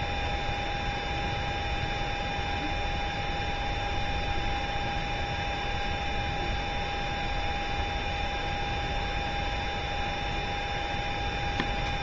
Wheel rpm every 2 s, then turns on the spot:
0, 0, 0, 0, 0, 0.
none